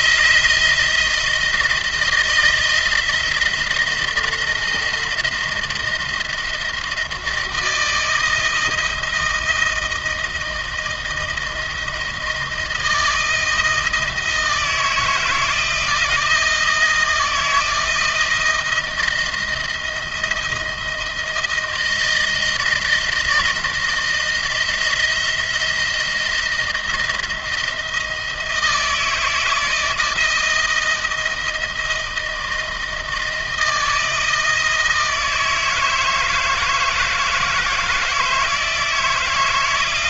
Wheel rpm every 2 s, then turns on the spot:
160, 160, 160, 170, 160, 160, 160, 160, 170, 160, 160, 170, 160, 160, 160, 160, 160, 160, 160, 160.
none